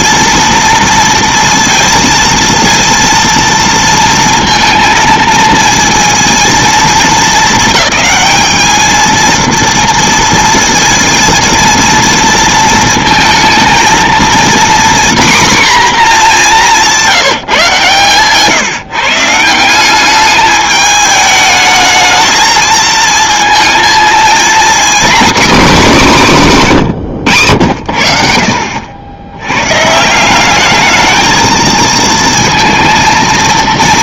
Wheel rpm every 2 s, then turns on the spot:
230, 230, 230, 230, 220, 230, 230, 240, 190, 150, 210, 220, 240, 170, 70, 200, 230.
none